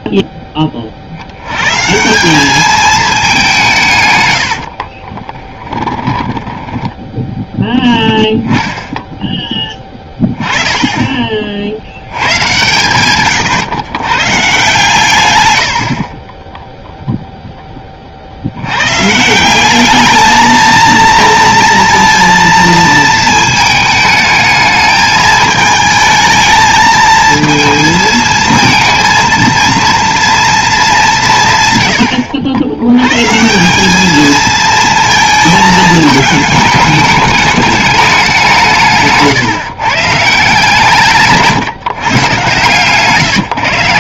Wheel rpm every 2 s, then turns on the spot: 70, 190, 20, 10, 10, 70, 110, 80, 30, 210, 230, 220, 220, 230, 230, 110, 210, 220, 200, 150, 140, 120.
4-6